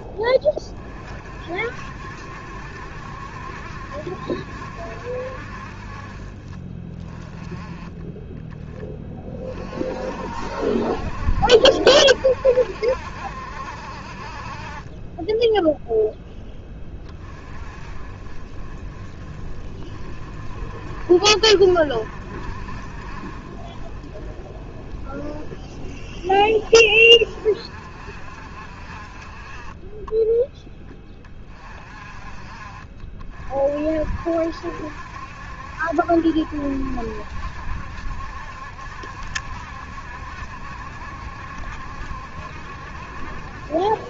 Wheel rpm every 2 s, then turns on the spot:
40, 70, 70, 30, 20, 50, 70, 20, 10, 30, 40, 40, 30, 30, 50, 10, 40, 70, 70, 70, 70, 70.
none